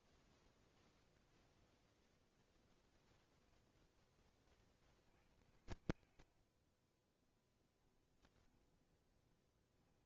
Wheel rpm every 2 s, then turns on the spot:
0, 0, 30, 30, 20.
8-10